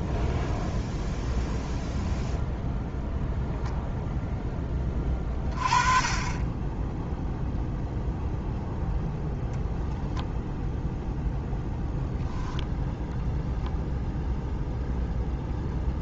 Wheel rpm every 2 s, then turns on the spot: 0, 0, 10, 10, 0, 0, 0, 0.
none